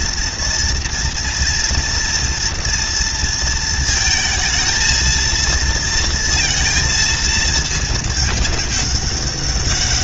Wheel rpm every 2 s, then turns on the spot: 240, 230, 220, 230, 210.
none